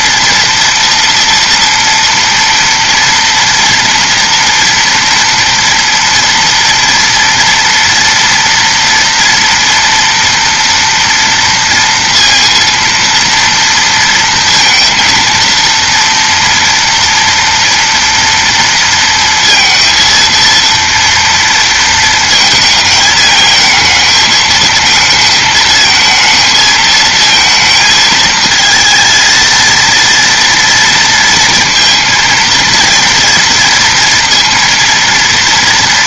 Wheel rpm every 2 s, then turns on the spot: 240, 230, 230, 230, 230, 230, 230, 230, 230, 230, 230, 220, 220, 230, 230, 230, 230, 230.
none